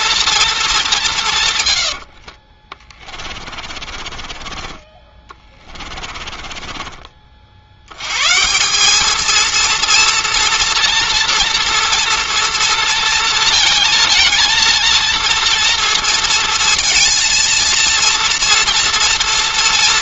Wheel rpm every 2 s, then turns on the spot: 210, 30, 20, 30, 200, 230, 230, 230, 230, 230.
2-8